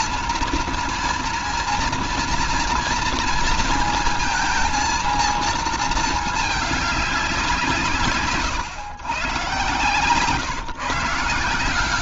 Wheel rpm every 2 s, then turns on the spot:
230, 230, 230, 200, 130, 160.
none